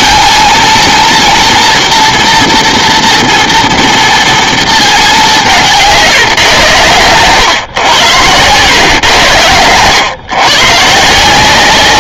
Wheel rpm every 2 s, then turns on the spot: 230, 230, 220, 120, 110, 140.
none